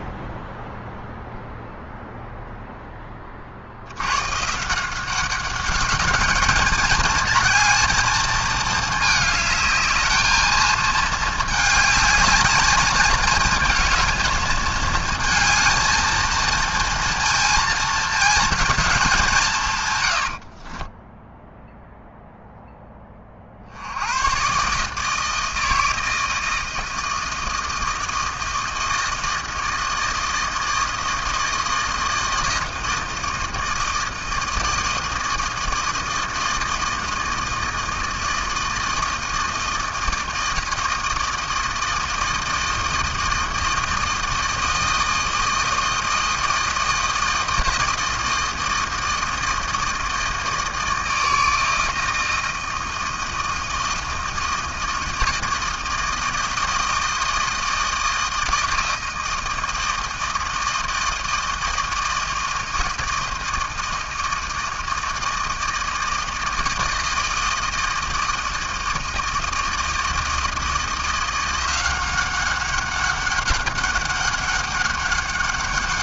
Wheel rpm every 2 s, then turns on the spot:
0, 0, 150, 210, 220, 220, 210, 220, 230, 230, 50, 0, 120, 160, 160, 160, 160, 160, 160, 160, 160, 160, 160, 160, 160, 160, 160, 160, 160, 160, 160, 160, 160, 160, 160, 170, 190, 200.
20-22